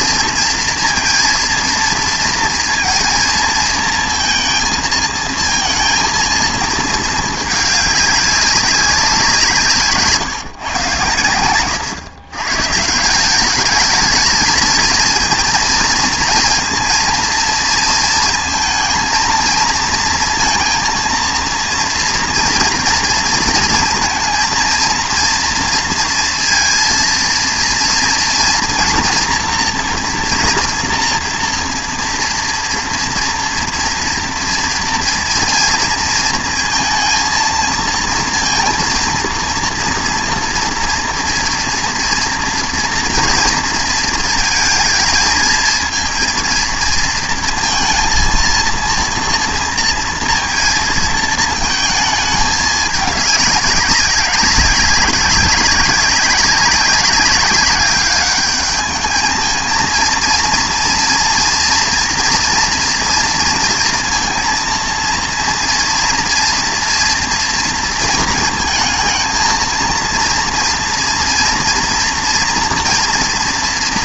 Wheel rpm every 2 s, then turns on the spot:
230, 230, 220, 220, 200, 140, 150, 220, 230, 230, 230, 230, 230, 230, 230, 240, 230, 230, 230, 230, 230, 230, 230, 230, 230, 230, 220, 200, 190, 210, 230, 240, 230, 230, 230, 230, 240.
none